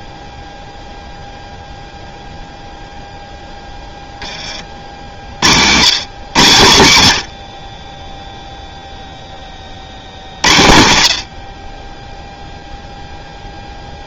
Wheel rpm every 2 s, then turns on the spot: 0, 0, 50, 100, 20, 60, 0.
none